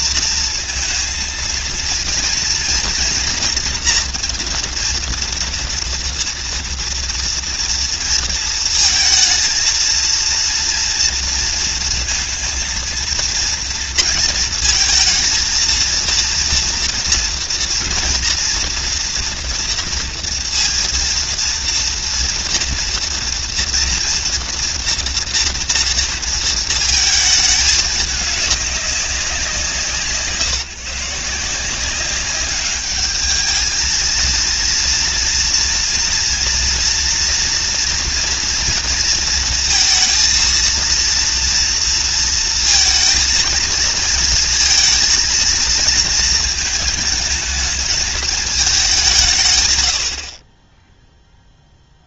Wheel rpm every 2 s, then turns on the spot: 230, 240, 230, 230, 230, 230, 230, 230, 230, 240, 230, 240, 230, 230, 200, 160, 200, 230, 230, 230, 230, 230, 230, 220, 200, 20.
none